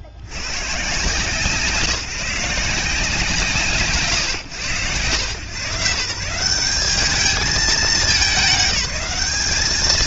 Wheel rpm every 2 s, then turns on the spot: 20, 160, 130, 140, 210.
none